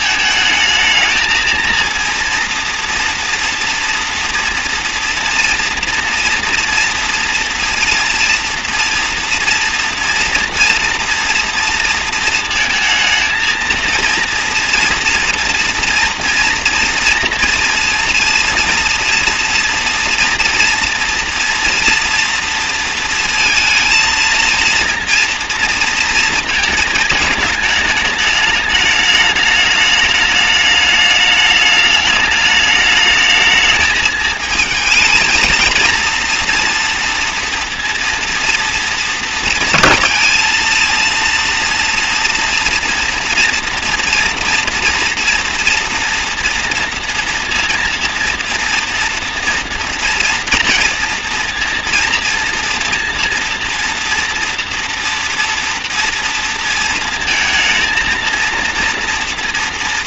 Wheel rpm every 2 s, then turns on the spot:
220, 230, 230, 240, 230, 230, 220, 230, 230, 230, 240, 230, 230, 220, 210, 210, 210, 220, 230, 230, 230, 230, 230, 240, 230, 230, 230, 230, 230, 230.
none